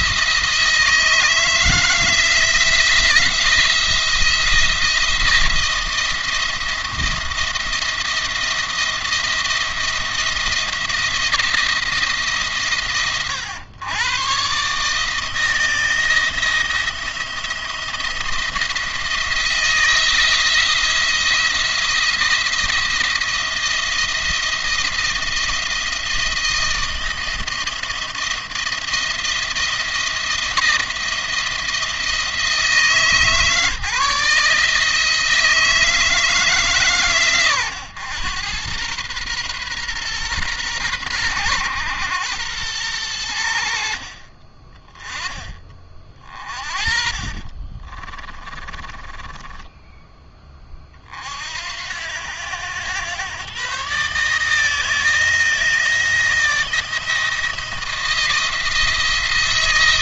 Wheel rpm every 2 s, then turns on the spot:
160, 170, 170, 170, 170, 170, 130, 130, 170, 170, 160, 170, 170, 170, 170, 170, 160, 160, 150, 110, 120, 100, 20, 40, 20, 30, 100, 160, 170, 170.
46-50